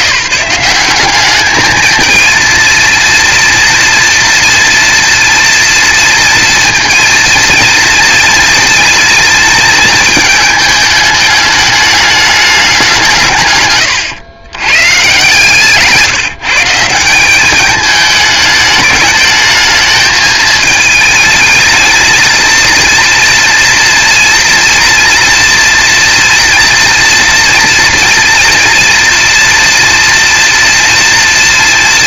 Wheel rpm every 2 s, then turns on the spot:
190, 230, 230, 230, 220, 210, 190, 130, 170, 210, 220, 230, 240, 230, 230, 230.
none